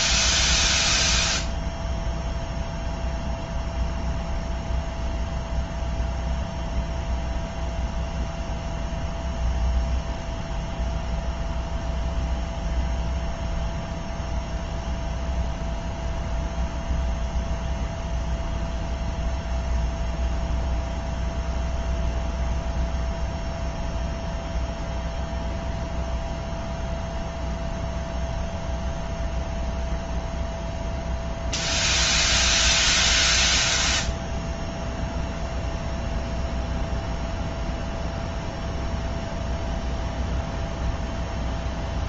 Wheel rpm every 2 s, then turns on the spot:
0, 0, 0, 0, 0, 0, 0, 0, 0, 0, 0, 0, 0, 0, 0, 0, 0, 0, 0, 0, 0.
none